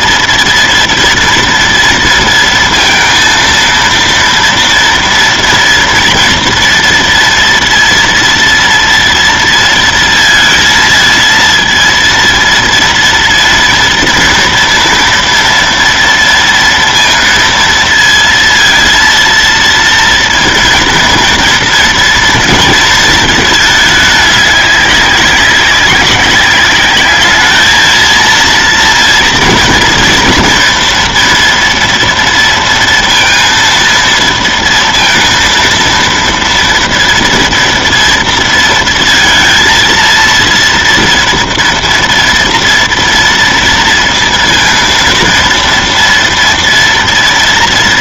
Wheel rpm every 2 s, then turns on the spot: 230, 230, 230, 230, 230, 220, 230, 230, 230, 230, 230, 230, 200, 200, 230, 230, 230, 230, 230, 230, 230, 230, 230, 230.
none